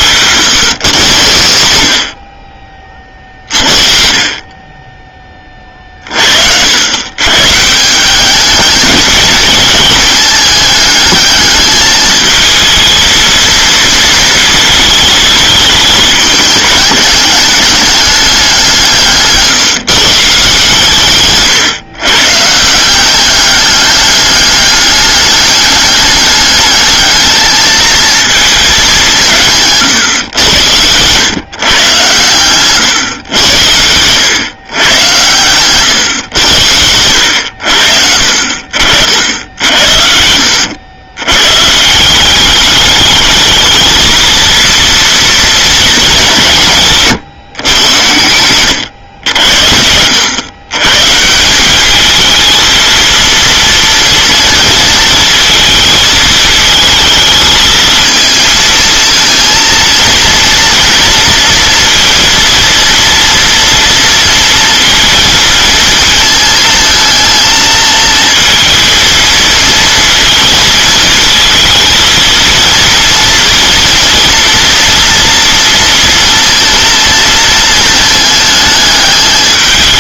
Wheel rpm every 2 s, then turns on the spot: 120, 30, 20, 110, 210, 210, 220, 220, 210, 170, 150, 180, 200, 210, 200, 110, 130, 120, 80, 60, 100, 210, 230, 150, 100, 130, 230, 230, 220, 230, 240, 230, 230, 220, 220, 220, 230, 230, 230, 210.
32-34 46-48